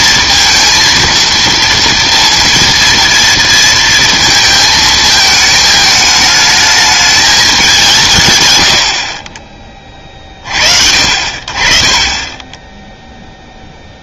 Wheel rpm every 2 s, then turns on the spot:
230, 230, 220, 220, 90, 40, 10.
none